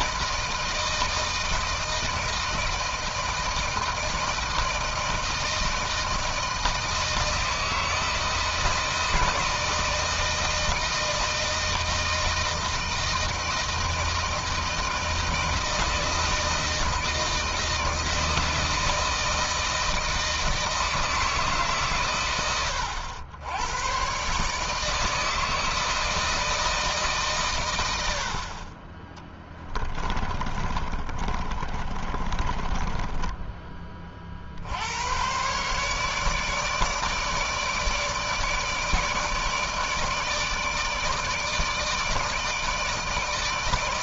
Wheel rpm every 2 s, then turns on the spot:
160, 160, 160, 160, 160, 160, 160, 160, 160, 160, 160, 90, 160, 150, 20, 30, 10, 90, 150, 150, 150, 160.
28-34